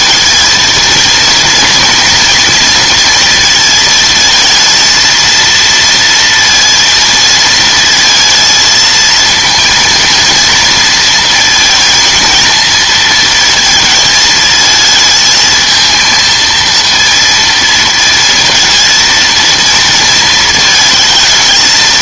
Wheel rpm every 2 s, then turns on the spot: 230, 230, 230, 230, 230, 230, 230, 220, 230, 230, 220.
none